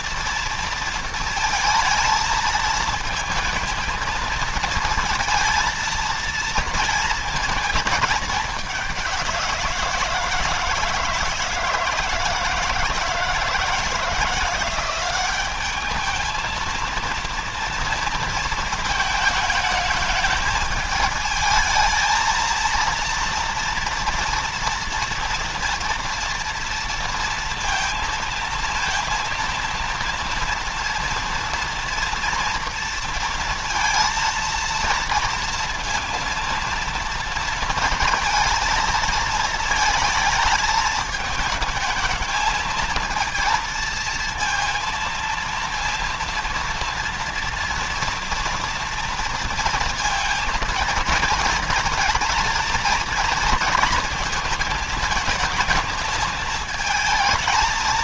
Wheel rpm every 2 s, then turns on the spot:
230, 220, 230, 230, 200, 170, 160, 170, 230, 230, 220, 230, 230, 230, 230, 230, 230, 230, 230, 230, 220, 220, 230, 230, 230, 220, 230, 230, 220.
none